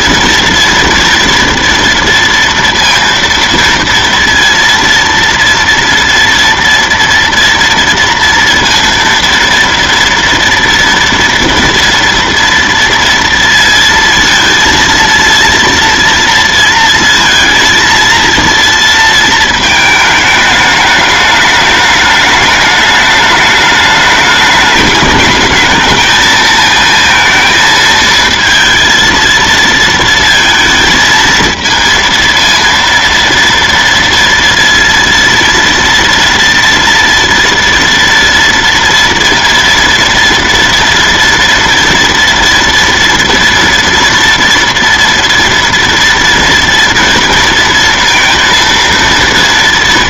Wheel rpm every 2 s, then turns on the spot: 230, 230, 230, 230, 230, 230, 230, 230, 230, 230, 210, 210, 210, 220, 230, 220, 230, 230, 230, 230, 230, 240, 230, 230, 230.
none